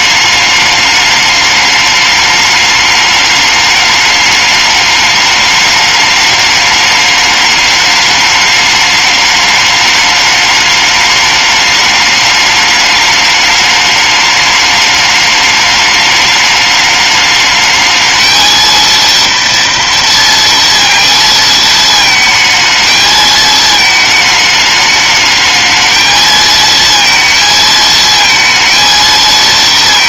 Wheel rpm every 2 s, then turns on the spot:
210, 210, 210, 210, 210, 210, 210, 210, 210, 230, 230, 220, 210, 230, 230.
none